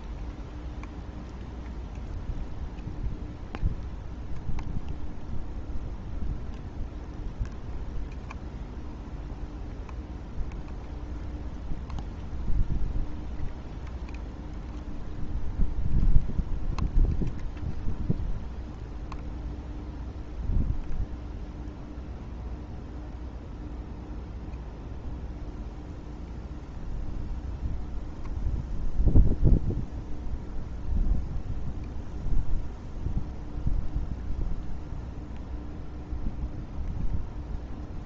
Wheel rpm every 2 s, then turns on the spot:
0, 0, 0, 0, 0, 0, 0, 0, 0, 0, 0, 0, 0, 0, 0, 0, 0, 0, 0.
none